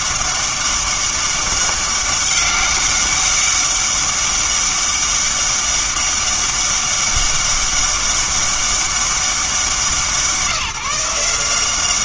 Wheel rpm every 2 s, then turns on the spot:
200, 200, 200, 200, 200, 170.
none